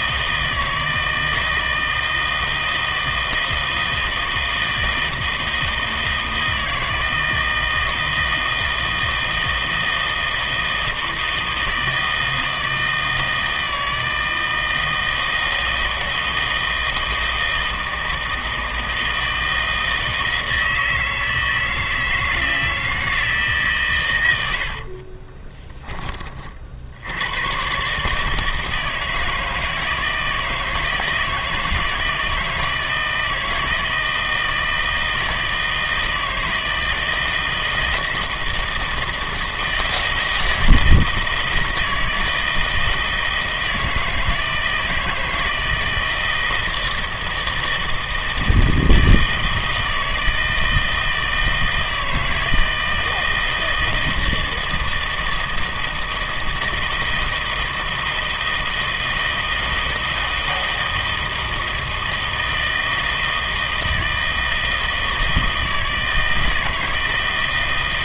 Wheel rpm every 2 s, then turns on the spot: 160, 160, 160, 160, 160, 160, 160, 160, 160, 160, 160, 160, 70, 60, 160, 160, 160, 160, 160, 160, 160, 160, 160, 160, 160, 160, 160, 160, 160, 160, 160, 160, 160, 160.
24-26